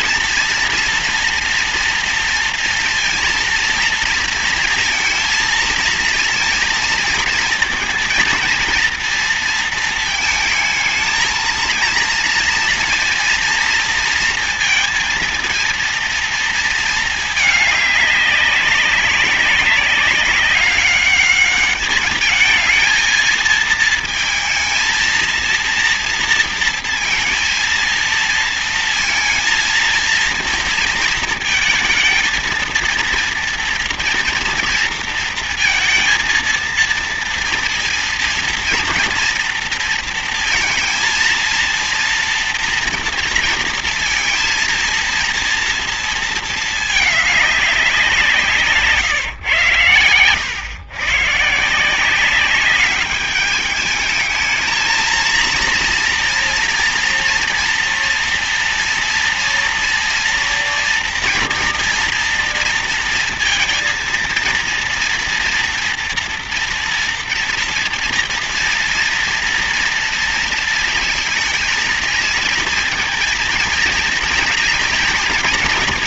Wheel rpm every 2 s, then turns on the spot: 230, 230, 230, 230, 230, 220, 230, 230, 220, 200, 200, 220, 230, 230, 230, 230, 230, 230, 230, 230, 230, 230, 230, 220, 150, 130, 200, 220, 230, 230, 230, 230, 230, 230, 230, 230, 230, 230.
none